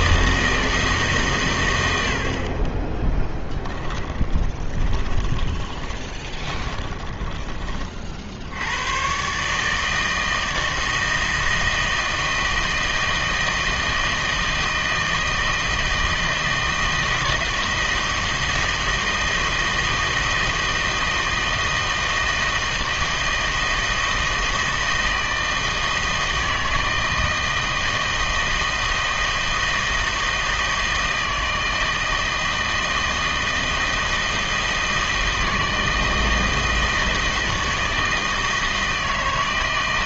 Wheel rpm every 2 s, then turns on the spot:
160, 20, 30, 20, 90, 160, 160, 160, 160, 160, 160, 160, 160, 160, 160, 160, 160, 160, 160, 160.
4-8